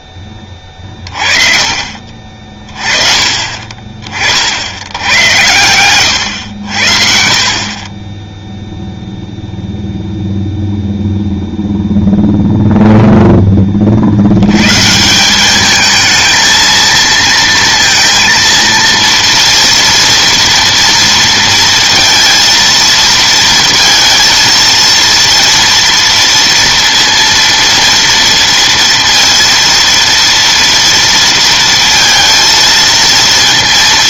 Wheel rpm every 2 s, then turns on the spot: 30, 40, 80, 80, 0, 0, 0, 110, 230, 230, 230, 230, 230, 230, 230, 230, 230.
none